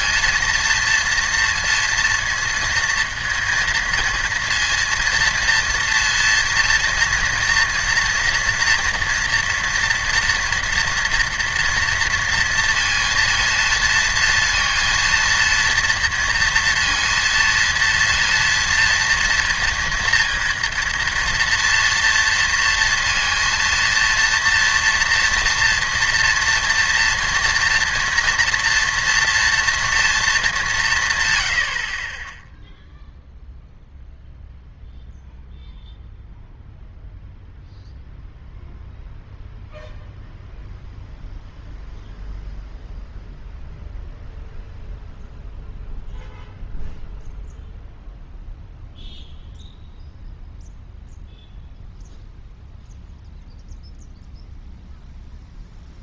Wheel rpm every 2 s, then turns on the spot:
230, 230, 230, 230, 230, 230, 230, 230, 230, 230, 230, 230, 240, 230, 230, 210, 0, 0, 0, 0, 0, 0, 0, 0, 0, 0, 0, 0.
none